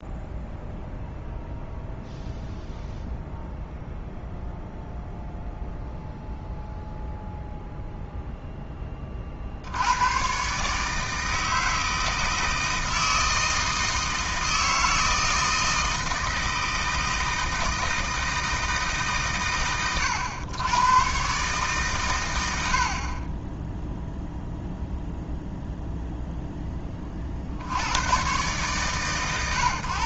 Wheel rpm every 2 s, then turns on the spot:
0, 0, 0, 0, 30, 150, 160, 160, 160, 150, 110, 50, 0, 20, 130.
none